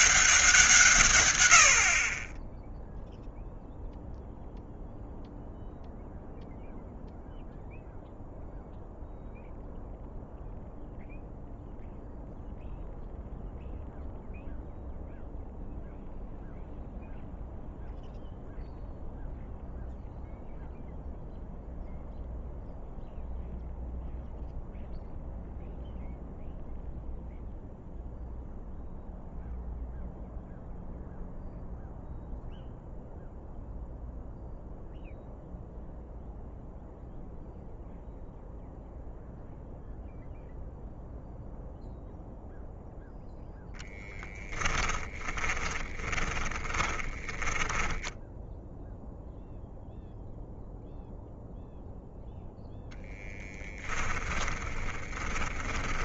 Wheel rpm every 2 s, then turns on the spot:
150, 0, 0, 0, 0, 0, 0, 0, 0, 0, 0, 0, 0, 0, 0, 0, 0, 0, 0, 0, 0, 0, 30, 20, 0, 0, 0, 30.
44-48 54-56